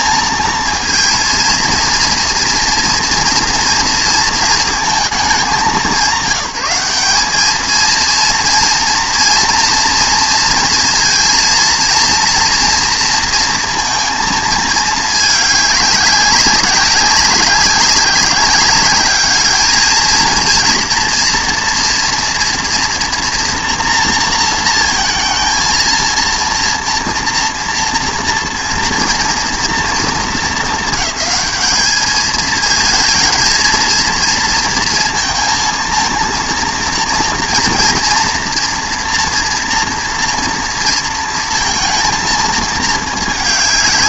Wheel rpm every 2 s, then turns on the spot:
230, 230, 230, 190, 230, 230, 230, 220, 190, 200, 230, 240, 230, 230, 240, 220, 220, 230, 230, 240, 230, 220.
none